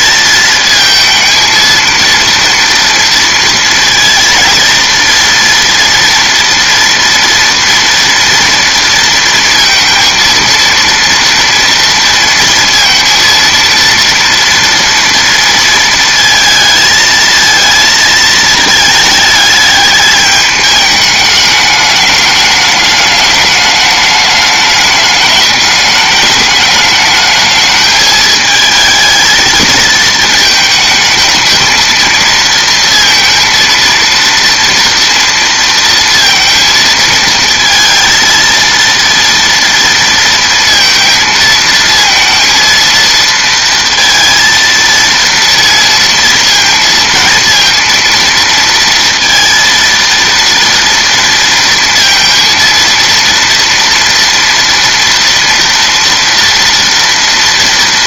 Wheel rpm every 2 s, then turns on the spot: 230, 230, 230, 230, 230, 230, 230, 230, 220, 220, 210, 210, 210, 210, 220, 220, 230, 230, 230, 230, 230, 230, 230, 230, 230, 230, 230, 230, 230.
none